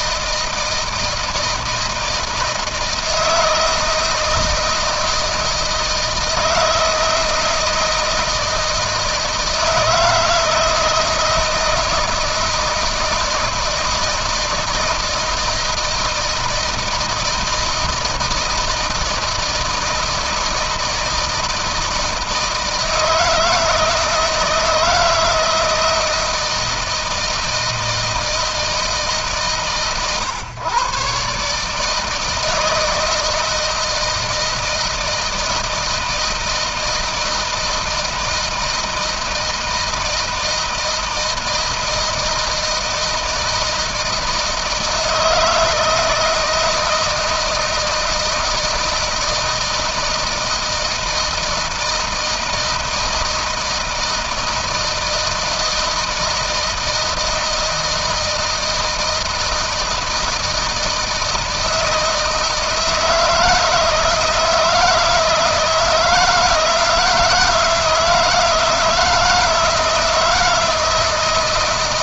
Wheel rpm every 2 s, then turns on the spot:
160, 160, 160, 160, 160, 160, 160, 160, 160, 160, 160, 160, 170, 160, 150, 130, 160, 160, 160, 160, 160, 160, 160, 160, 170, 160, 160, 160, 160, 160, 160, 160, 160, 160, 160, 160.
none